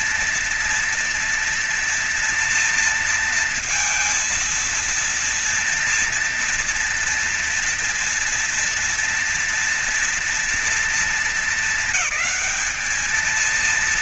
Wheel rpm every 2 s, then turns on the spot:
230, 230, 230, 230, 230, 210, 210.
none